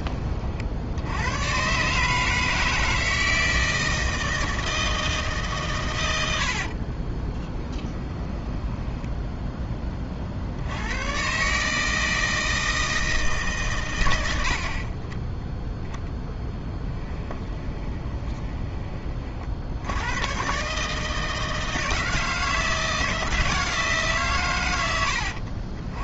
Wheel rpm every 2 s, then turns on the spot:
70, 160, 160, 40, 10, 100, 160, 30, 10, 30, 150, 160, 100.
6-10 16-18